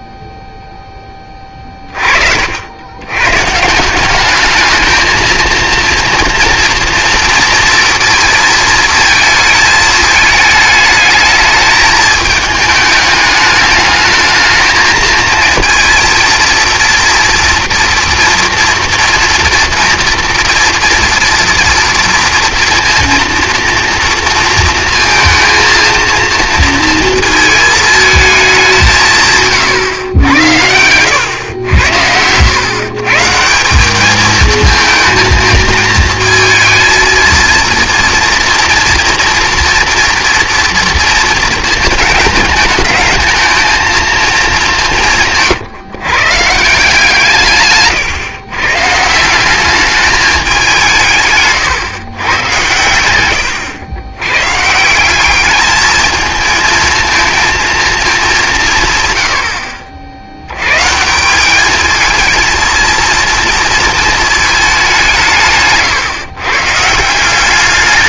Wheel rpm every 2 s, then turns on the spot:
0, 80, 210, 230, 230, 220, 210, 220, 230, 230, 230, 230, 230, 230, 190, 100, 130, 220, 220, 230, 230, 210, 180, 150, 130, 190, 120, 150, 220, 160, 110, 230, 200, 140.
52-54